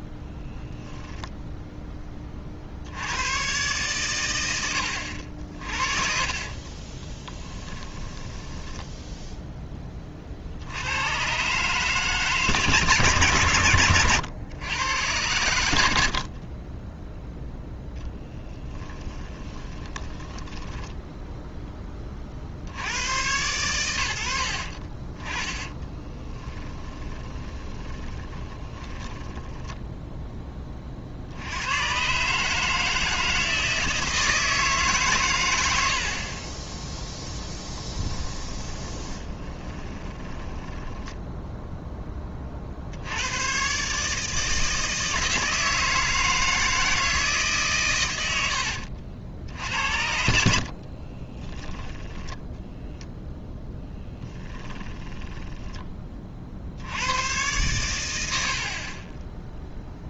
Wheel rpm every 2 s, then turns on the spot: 0, 70, 80, 30, 10, 90, 150, 110, 10, 10, 10, 80, 40, 20, 20, 40, 160, 150, 10, 10, 10, 70, 160, 160, 70, 40, 0, 20, 70, 40.
6-10 16-22 24-30 38-42 48-52 54-56